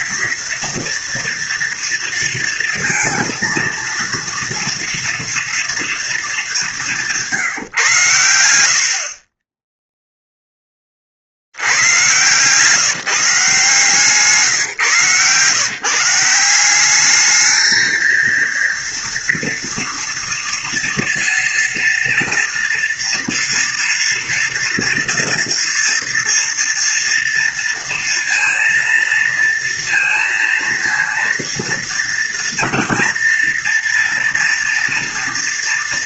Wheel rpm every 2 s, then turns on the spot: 230, 230, 230, 200, 90, 10, 130, 150, 180, 230, 230, 230, 230, 230, 230, 230, 240, 240.
none